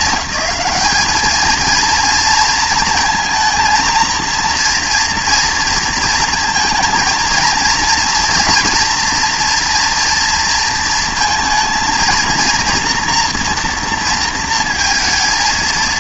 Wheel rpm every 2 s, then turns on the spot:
210, 230, 230, 230, 230, 230, 230, 230.
none